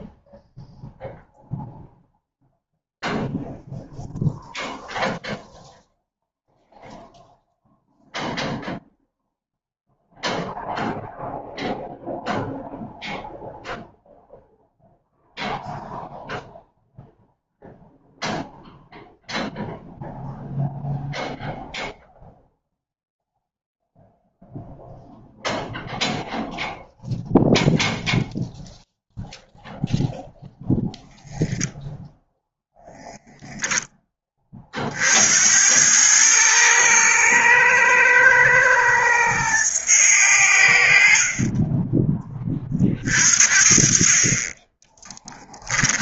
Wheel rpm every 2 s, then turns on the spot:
0, 0, 0, 0, 0, 0, 0, 0, 0, 0, 0, 0, 0, 0, 0, 0, 0, 50, 110, 110, 60, 40, 10.
none